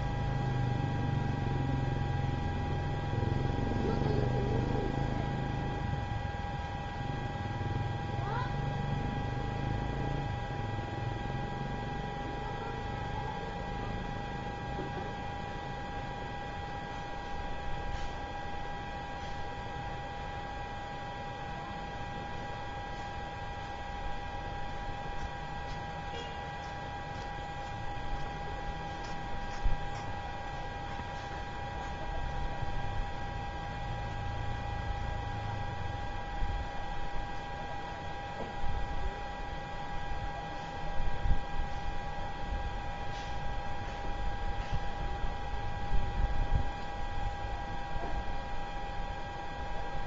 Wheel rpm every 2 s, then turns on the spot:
0, 0, 0, 0, 0, 0, 0, 0, 0, 0, 0, 0, 0, 0, 0, 0, 0, 0, 0, 0, 0, 0, 0, 0, 0.
none